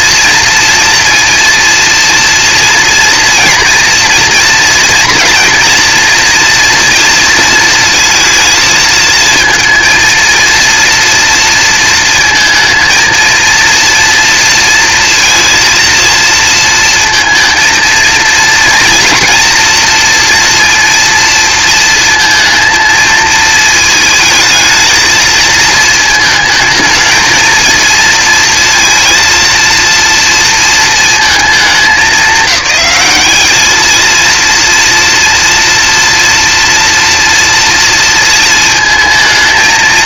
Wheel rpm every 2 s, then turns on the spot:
230, 230, 230, 240, 220, 230, 230, 230, 230, 230, 230, 220, 220, 220, 230, 220, 190, 230, 230, 220.
none